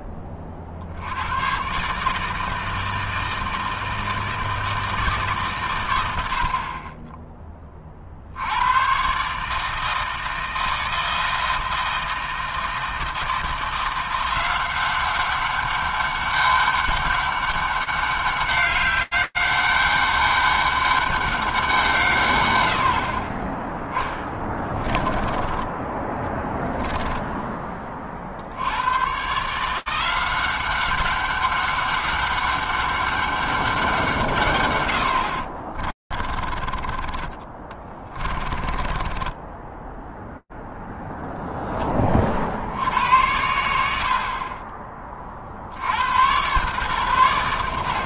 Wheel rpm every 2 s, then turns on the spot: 40, 160, 160, 60, 100, 160, 160, 180, 200, 200, 200, 60, 20, 10, 90, 190, 200, 120, 30, 40, 0, 50, 20, 110.
24-28 36-40